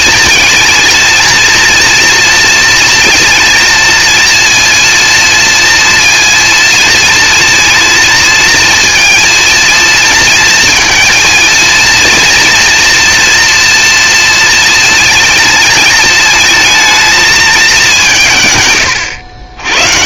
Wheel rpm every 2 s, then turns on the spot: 230, 230, 230, 230, 230, 230, 240, 230, 220, 100.
none